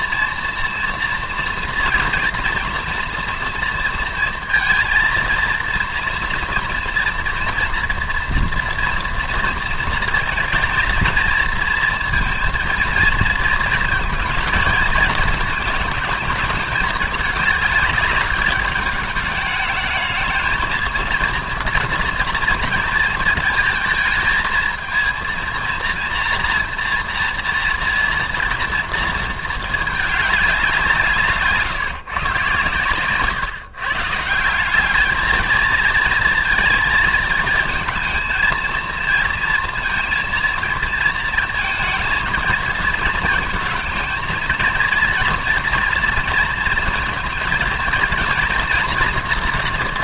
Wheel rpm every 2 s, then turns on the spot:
230, 240, 230, 230, 230, 230, 230, 220, 210, 210, 230, 230, 220, 230, 230, 190, 130, 190, 230, 230, 230, 220, 230, 230, 230.
none